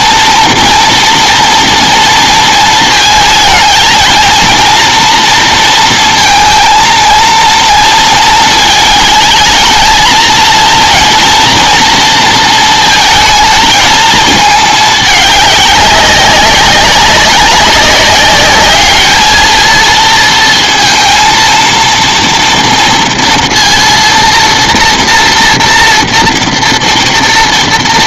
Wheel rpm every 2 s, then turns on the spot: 230, 230, 230, 230, 220, 230, 230, 220, 200, 210, 230, 230, 230, 230.
none